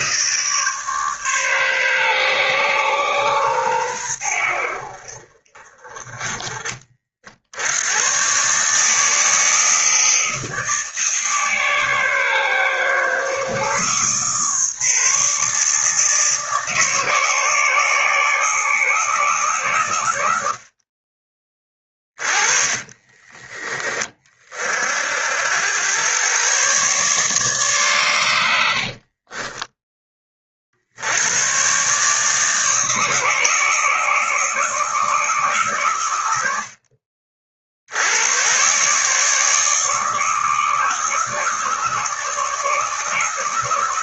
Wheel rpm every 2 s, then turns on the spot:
150, 120, 60, 40, 150, 160, 130, 150, 150, 160, 50, 30, 50, 130, 70, 60, 150, 160, 70, 130, 160, 160.
22-24 28-30